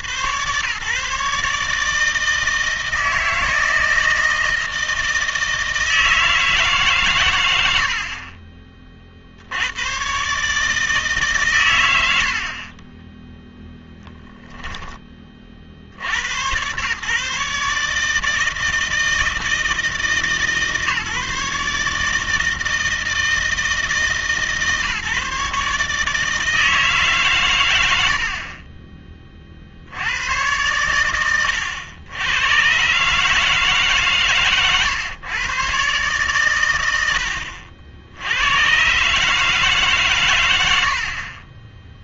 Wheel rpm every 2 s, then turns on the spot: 130, 160, 160, 150, 30, 150, 30, 10, 120, 160, 150, 160, 150, 160, 30, 110, 110, 130, 100, 110, 80.
12-14 34-36